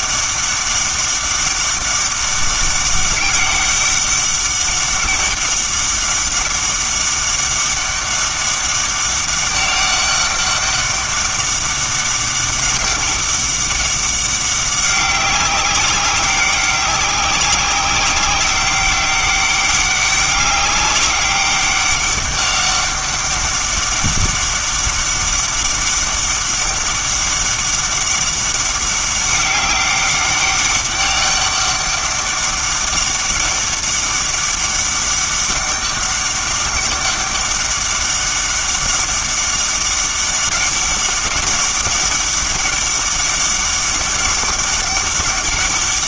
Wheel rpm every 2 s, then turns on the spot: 200, 200, 200, 200, 200, 200, 200, 190, 190, 190, 200, 200, 200, 200, 200, 200, 200, 200, 200, 200, 200, 200, 200.
none